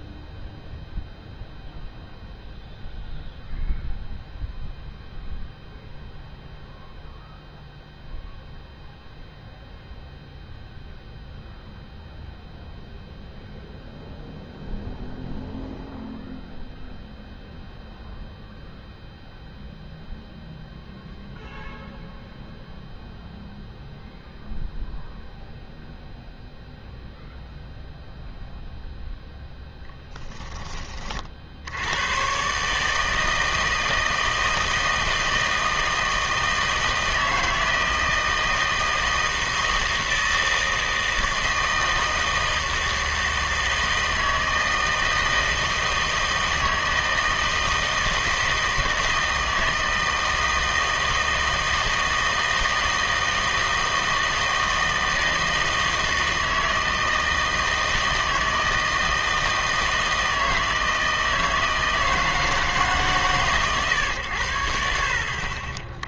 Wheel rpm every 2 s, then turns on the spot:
0, 0, 0, 0, 0, 0, 0, 0, 0, 0, 0, 0, 0, 0, 0, 20, 140, 160, 160, 160, 160, 160, 160, 160, 160, 160, 160, 160, 160, 160, 160, 160, 80.
none